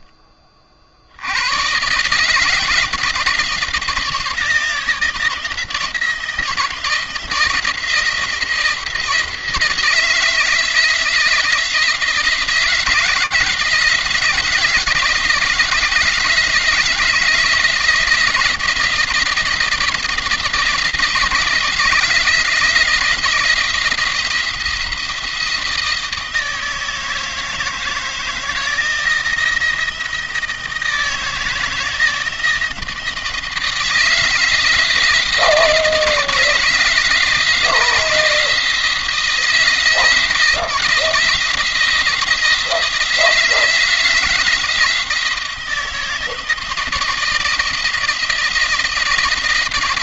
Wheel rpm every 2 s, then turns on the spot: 50, 160, 160, 170, 170, 170, 160, 170, 160, 160, 160, 170, 170, 160, 160, 160, 160, 160, 160, 170, 160, 160, 170, 160, 170.
none